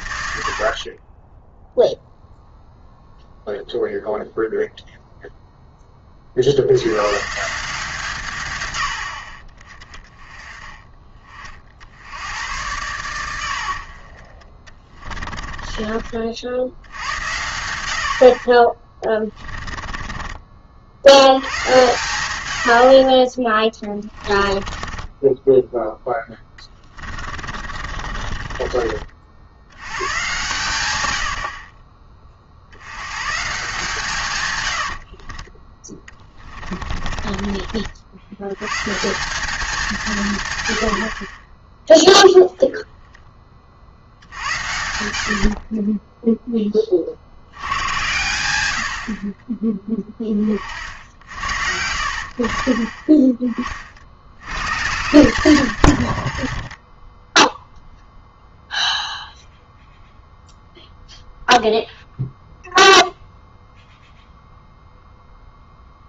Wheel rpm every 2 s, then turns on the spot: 60, 0, 0, 80, 110, 20, 90, 30, 70, 30, 50, 80, 20, 20, 40, 120, 70, 110, 30, 120, 110, 0, 80, 10, 90, 40, 40, 90, 40, 0, 0, 0, 0.
0-2 14-16 24-30 34-38